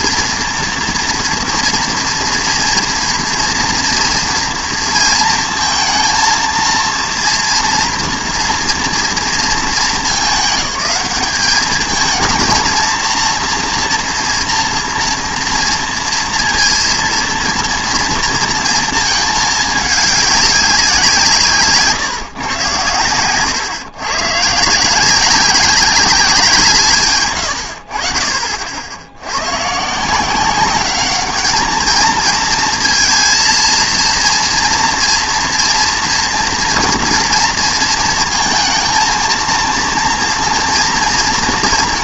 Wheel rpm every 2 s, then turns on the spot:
230, 230, 230, 230, 230, 200, 230, 230, 230, 230, 200, 130, 130, 170, 50, 190, 230, 230, 230, 230, 230.
none